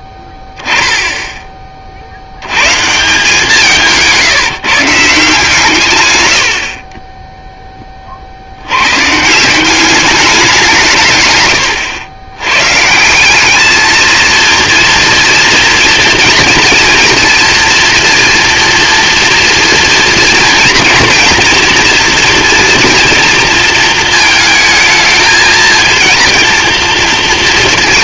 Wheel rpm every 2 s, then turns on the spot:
10, 130, 170, 50, 90, 180, 140, 230, 230, 230, 230, 230, 220, 230.
none